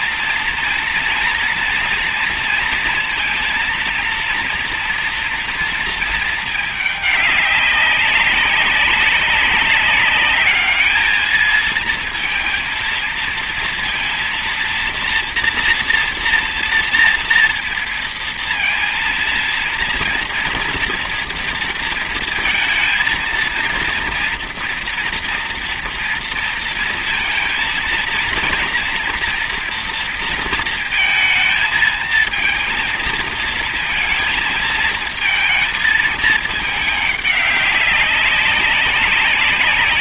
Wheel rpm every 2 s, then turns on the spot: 230, 230, 230, 210, 200, 220, 230, 230, 230, 230, 240, 230, 240, 230, 230, 230, 230, 220, 210, 190.
none